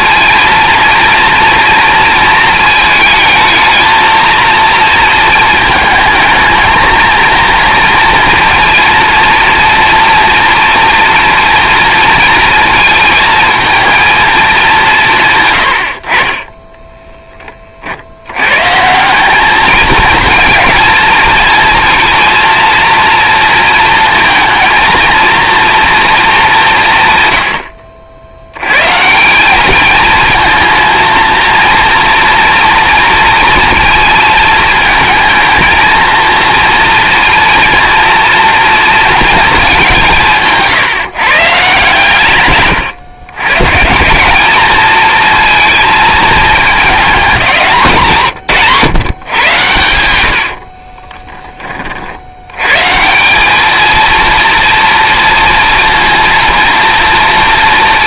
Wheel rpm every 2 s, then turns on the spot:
230, 220, 230, 230, 230, 240, 220, 140, 10, 190, 220, 230, 230, 130, 160, 230, 230, 220, 230, 230, 150, 110, 220, 200, 120, 30, 160, 230, 230.
50-52